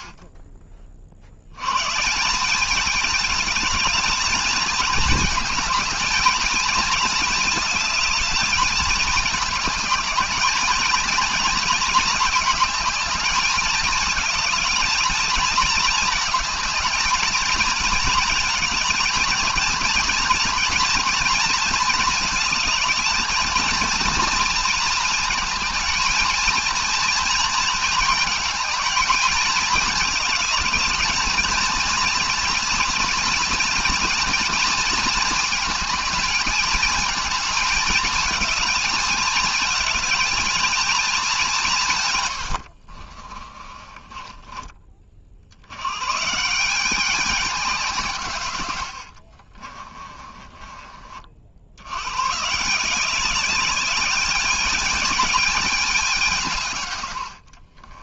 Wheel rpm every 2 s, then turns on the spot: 40, 210, 230, 220, 220, 220, 220, 220, 220, 230, 230, 220, 230, 230, 210, 210, 230, 220, 220, 220, 220, 40, 30, 190, 80, 30, 180, 210, 110.
42-44 48-50